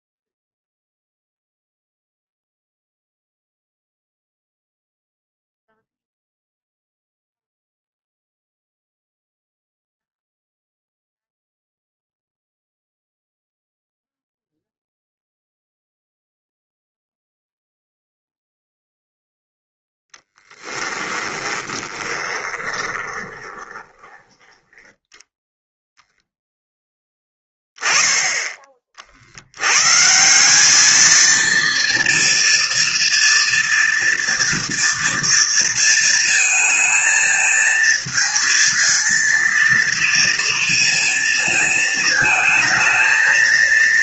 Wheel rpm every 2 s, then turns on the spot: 0, 0, 0, 0, 0, 0, 0, 0, 0, 0, 10, 20, 10, 10, 40, 210, 230, 230, 220, 230, 230, 220.
20-24